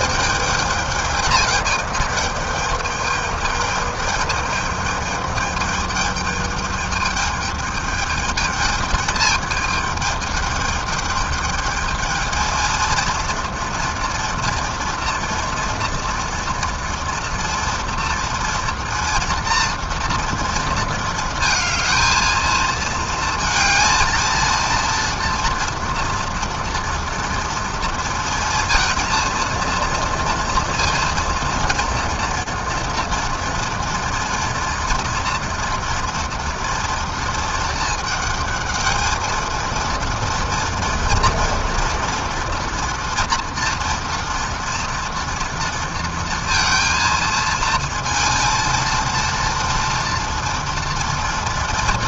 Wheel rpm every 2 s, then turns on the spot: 210, 210, 210, 220, 220, 210, 220, 230, 230, 230, 230, 220, 230, 230, 230, 230, 230, 230, 230, 220, 230, 230, 230, 230, 230, 230.
none